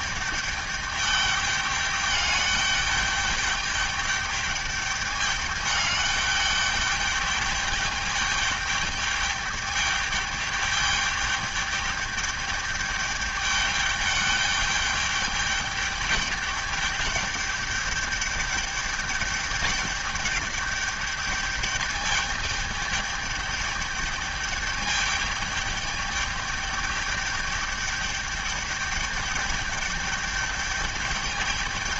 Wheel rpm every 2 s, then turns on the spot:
210, 210, 210, 210, 210, 210, 210, 210, 200, 210, 210, 210, 210, 210, 210, 210.
none